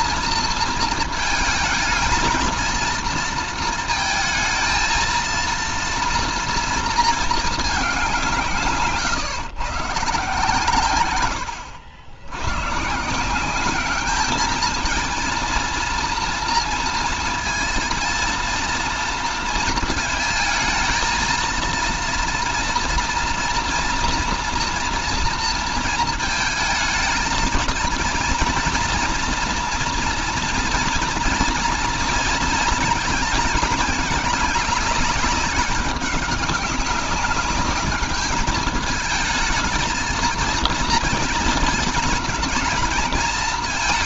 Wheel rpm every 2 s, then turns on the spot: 230, 230, 230, 230, 160, 120, 150, 220, 230, 230, 220, 230, 230, 220, 230, 230, 230, 200, 190, 220, 230, 220.
none